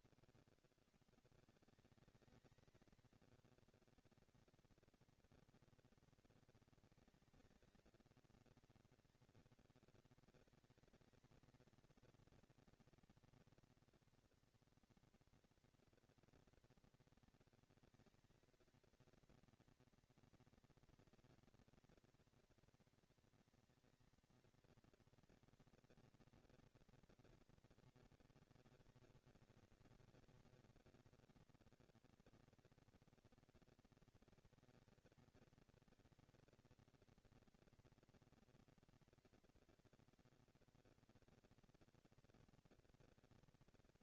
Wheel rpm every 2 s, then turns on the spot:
140, 220, 220, 220, 230, 220, 230, 240, 230, 230, 230, 240, 230, 230, 190, 200, 230, 220, 230, 230, 230, 230.
none